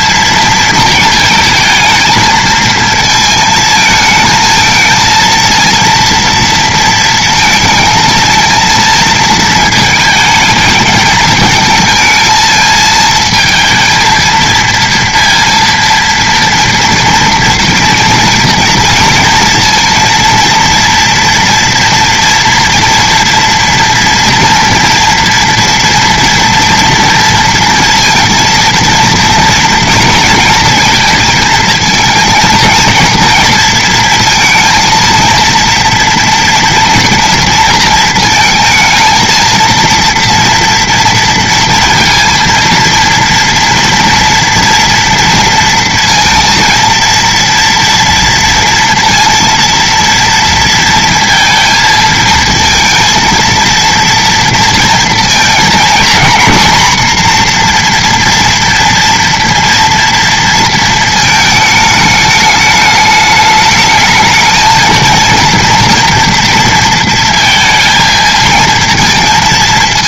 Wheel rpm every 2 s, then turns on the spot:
230, 220, 230, 230, 230, 220, 220, 230, 230, 230, 230, 240, 230, 230, 230, 230, 230, 230, 240, 230, 230, 230, 230, 230, 230, 230, 230, 230, 240, 230, 230, 210, 220, 230, 230.
none